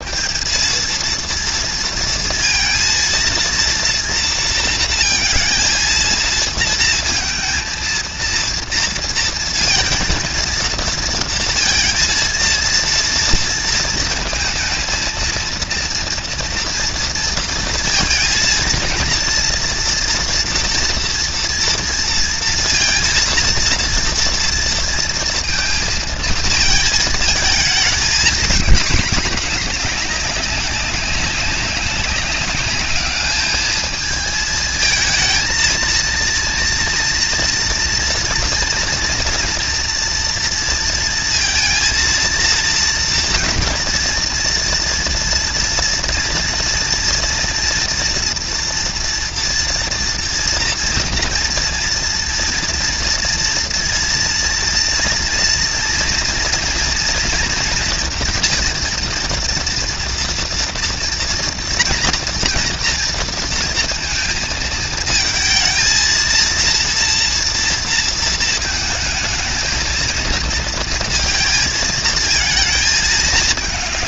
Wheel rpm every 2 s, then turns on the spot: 220, 230, 230, 230, 230, 230, 230, 220, 230, 230, 230, 230, 230, 230, 220, 200, 210, 220, 230, 230, 230, 230, 230, 230, 230, 230, 230, 230, 230, 230, 230, 230, 220, 230, 220, 230, 220.
none